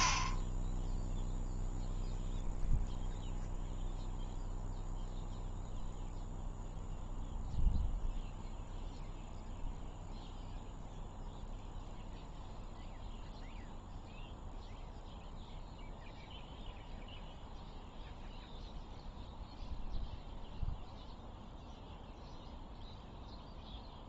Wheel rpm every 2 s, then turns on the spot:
10, 0, 0, 0, 0, 0, 0, 0, 0, 0, 0, 0.
none